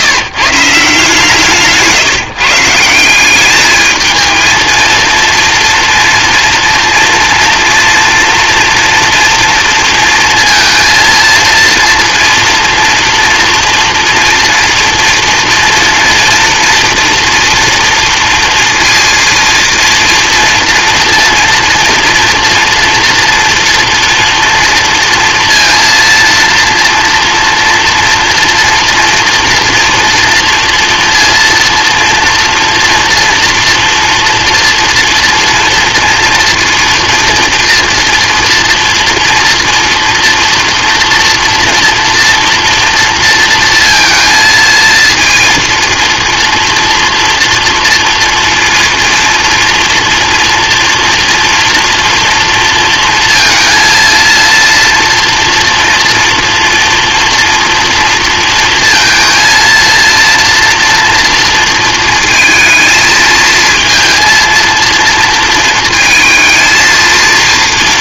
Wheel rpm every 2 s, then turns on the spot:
150, 160, 230, 230, 240, 230, 230, 230, 230, 230, 230, 230, 240, 230, 230, 230, 230, 230, 240, 230, 230, 230, 230, 240, 240, 230, 240, 230, 230, 230, 230, 230, 230, 230.
none